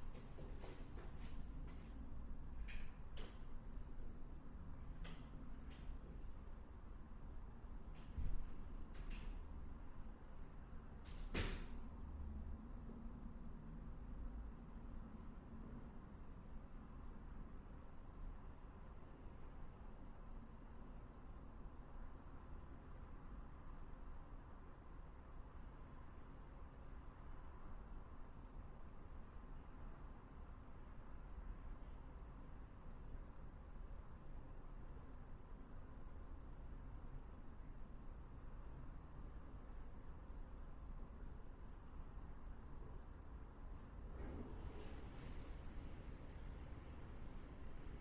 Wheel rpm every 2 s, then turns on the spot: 0, 0, 0, 0, 0, 0, 0, 0, 0, 0, 0, 0, 0, 0, 0, 0, 0, 0, 0, 0, 0, 0, 0, 0.
none